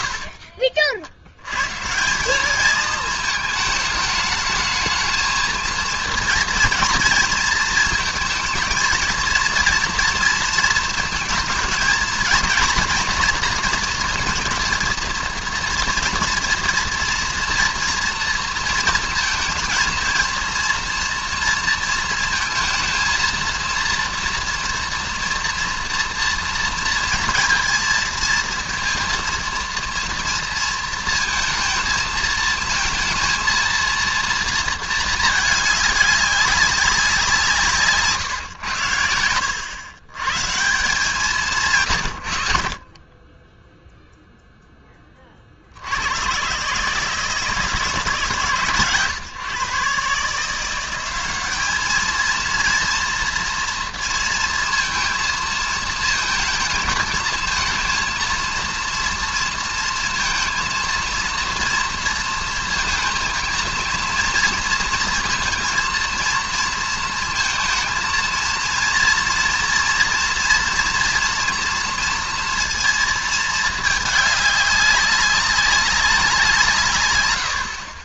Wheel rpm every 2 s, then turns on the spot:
50, 210, 220, 230, 230, 230, 230, 230, 240, 230, 230, 230, 230, 230, 230, 230, 230, 220, 200, 120, 170, 60, 10, 140, 140, 180, 230, 230, 220, 230, 230, 220, 230, 230, 230, 240, 230, 200, 150.
none